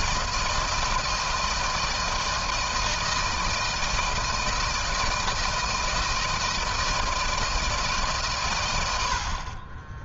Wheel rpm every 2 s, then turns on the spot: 160, 160, 160, 160, 110.
none